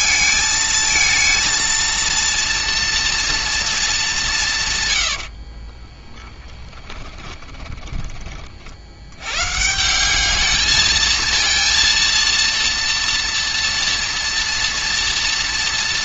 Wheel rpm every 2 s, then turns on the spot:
220, 230, 170, 10, 40, 210, 230, 230.
6-8